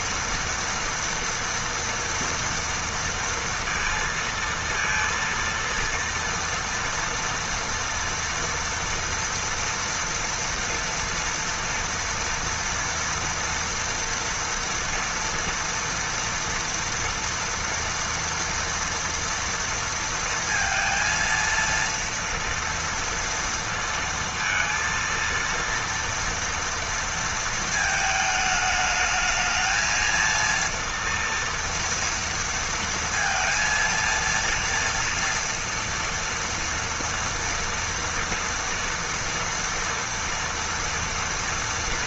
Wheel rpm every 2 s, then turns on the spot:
230, 230, 230, 230, 230, 230, 240, 230, 230, 230, 230, 230, 230, 230, 210, 230, 230, 230, 230, 230, 230.
none